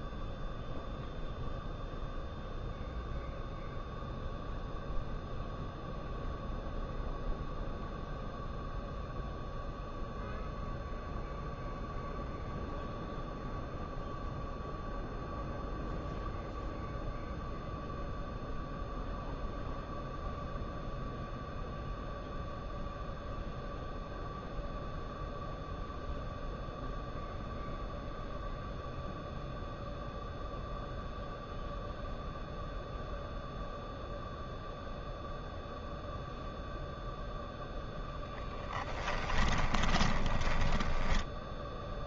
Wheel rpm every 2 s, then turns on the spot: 0, 0, 0, 0, 0, 0, 0, 0, 0, 0, 0, 0, 0, 0, 0, 0, 0, 0, 0, 10, 10.
38-42